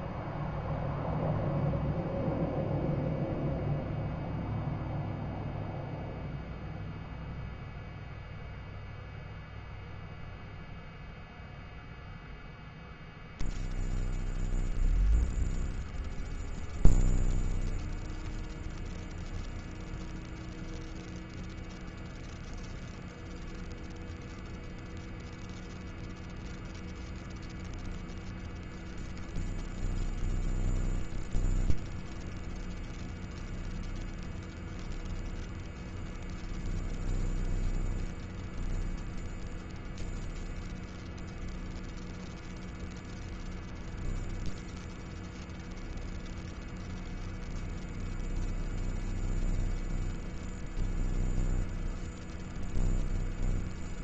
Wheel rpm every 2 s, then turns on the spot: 0, 0, 0, 0, 0, 0, 0, 0, 0, 0, 0, 0, 0, 0, 0, 0, 0, 0, 0, 0, 0, 0, 0, 0, 0, 0, 0.
none